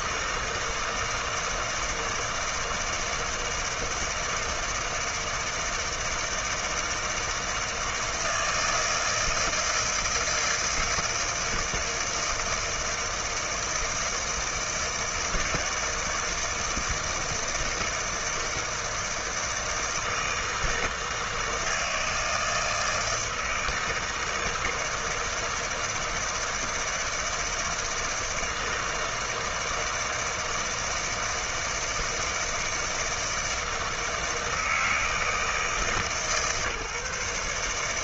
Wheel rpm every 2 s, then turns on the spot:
160, 160, 160, 160, 160, 160, 160, 160, 160, 160, 160, 160, 160, 160, 160, 160, 160, 160, 140.
none